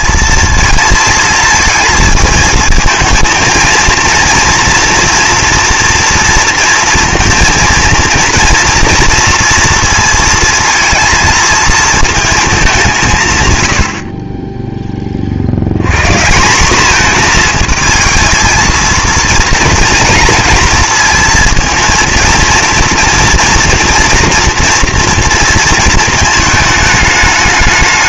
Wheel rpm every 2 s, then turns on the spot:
230, 220, 230, 230, 230, 230, 200, 10, 190, 230, 230, 230, 230, 220.
none